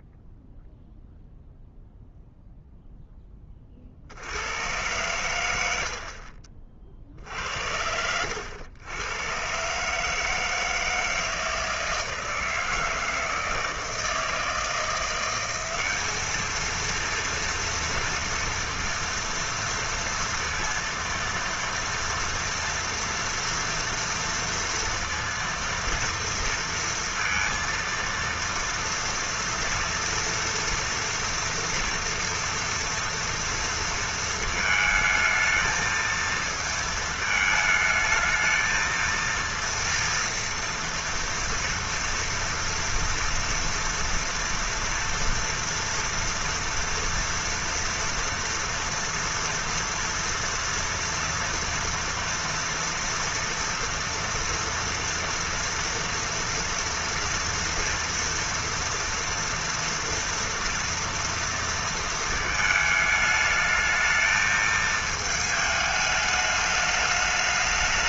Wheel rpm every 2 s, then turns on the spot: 0, 0, 100, 40, 100, 160, 160, 160, 220, 230, 230, 230, 230, 230, 230, 230, 230, 220, 220, 220, 230, 230, 230, 240, 230, 230, 230, 230, 230, 230, 240, 220, 220, 210.
none